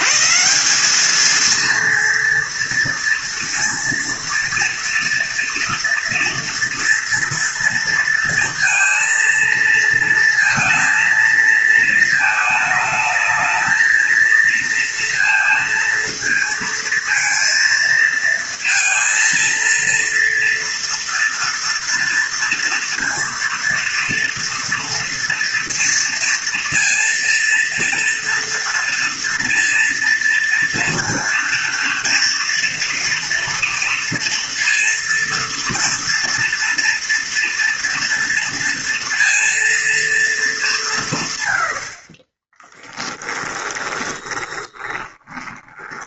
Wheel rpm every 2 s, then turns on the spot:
190, 230, 230, 230, 230, 230, 220, 230, 230, 230, 230, 230, 230, 230, 230, 230, 230, 230, 230, 230, 170, 10, 20.
42-46